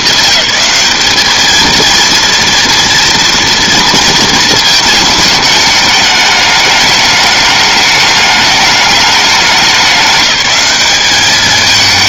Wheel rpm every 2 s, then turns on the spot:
220, 230, 220, 210, 210, 200.
none